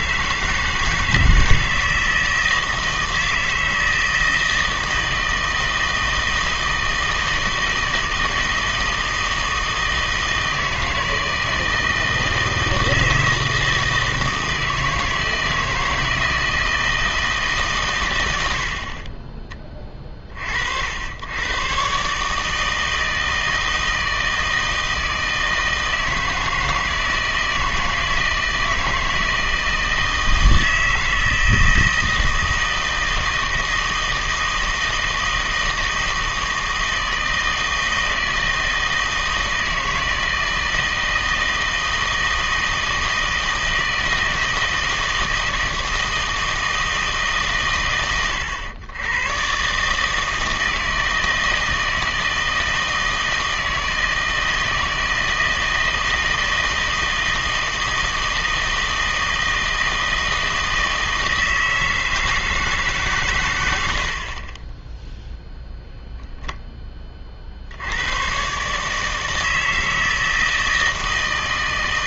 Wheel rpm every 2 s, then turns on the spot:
160, 160, 160, 160, 160, 160, 160, 160, 160, 70, 60, 150, 160, 160, 160, 160, 160, 160, 160, 160, 160, 160, 160, 160, 100, 160, 160, 160, 160, 160, 160, 160, 20, 10, 140, 160.
none